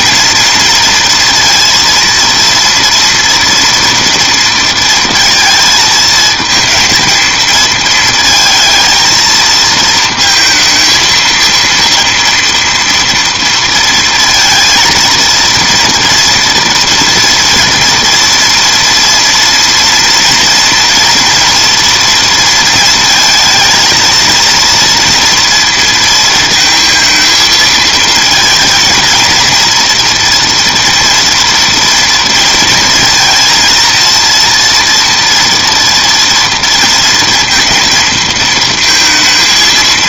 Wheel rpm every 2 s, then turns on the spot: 230, 230, 230, 230, 220, 230, 230, 230, 230, 230, 230, 230, 230, 220, 230, 230, 230, 230, 230, 230.
none